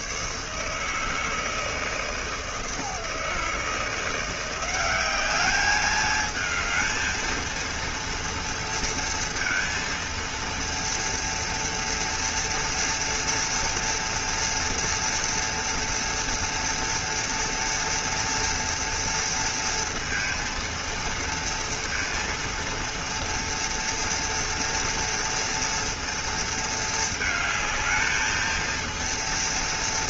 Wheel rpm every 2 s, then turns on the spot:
160, 160, 190, 220, 230, 230, 230, 230, 230, 230, 230, 230, 230, 220, 230.
none